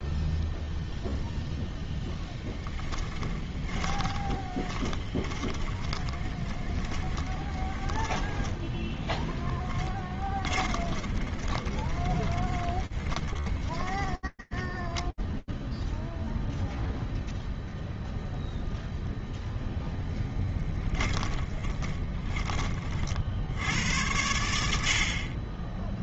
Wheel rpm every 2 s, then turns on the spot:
0, 10, 20, 20, 10, 20, 40, 20, 0, 0, 20, 70, 40.
2-8 10-16 20-22